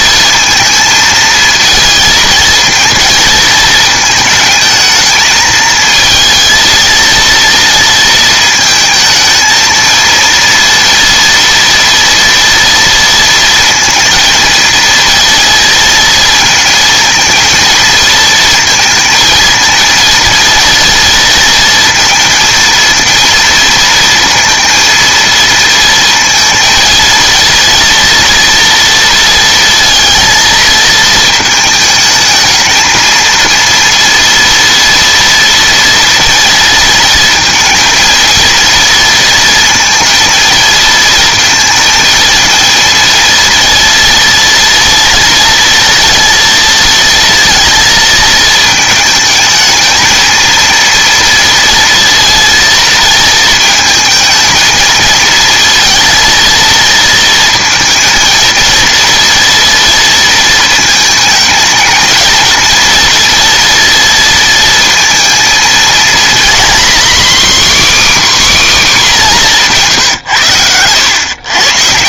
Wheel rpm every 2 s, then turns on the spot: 220, 220, 220, 230, 220, 230, 230, 230, 230, 220, 230, 230, 230, 230, 230, 230, 220, 230, 230, 230, 230, 230, 240, 230, 220, 230, 230, 230, 230, 230, 220, 230, 230, 250, 270, 110.
none